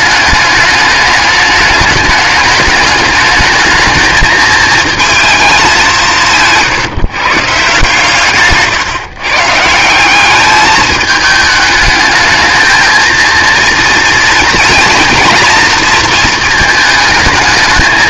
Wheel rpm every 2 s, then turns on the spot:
210, 210, 230, 160, 140, 210, 220, 230, 220.
8-10